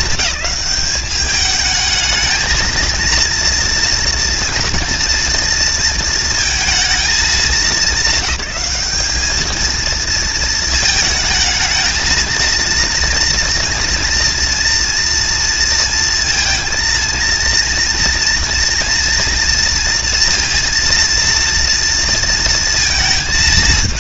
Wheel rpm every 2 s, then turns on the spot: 210, 230, 230, 220, 200, 220, 230, 230, 230, 230, 230, 220.
none